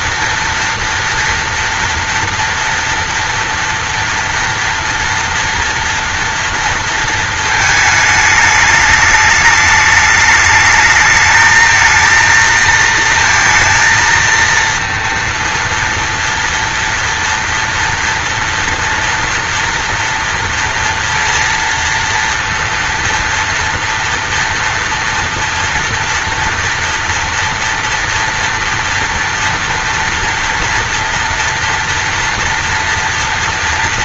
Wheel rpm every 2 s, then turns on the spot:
240, 230, 230, 230, 210, 220, 230, 230, 230, 230, 230, 230, 230, 230, 240, 230, 240.
none